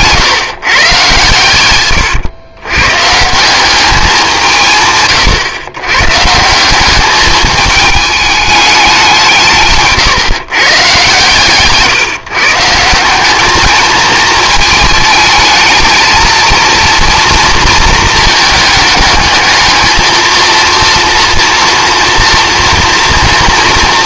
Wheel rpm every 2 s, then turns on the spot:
130, 110, 150, 180, 200, 140, 170, 220, 230, 220, 230, 230.
none